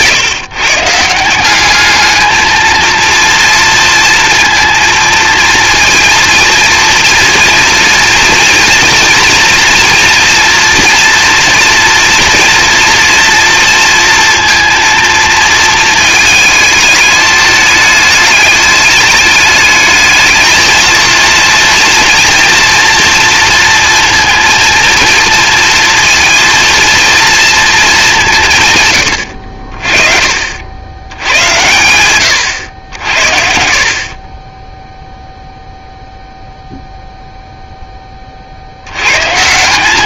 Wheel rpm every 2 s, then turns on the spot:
190, 230, 230, 230, 230, 230, 230, 230, 210, 210, 230, 230, 230, 230, 80, 100, 60, 0, 0, 100.
none